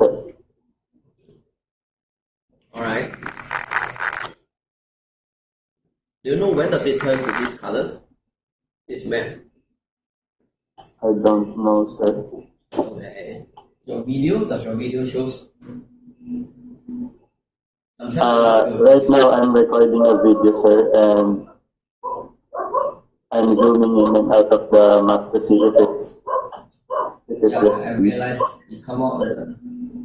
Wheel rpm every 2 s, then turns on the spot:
0, 0, 0, 0, 0, 0, 0, 0, 0, 0, 0, 0, 0, 0, 0.
none